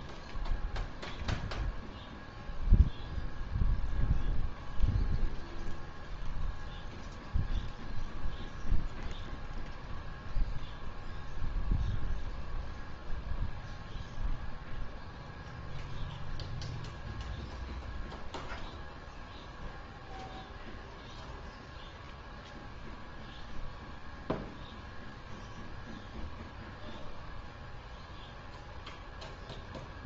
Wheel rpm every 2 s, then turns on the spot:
0, 0, 0, 0, 0, 0, 0, 0, 0, 0, 0, 0, 0, 0, 0.
none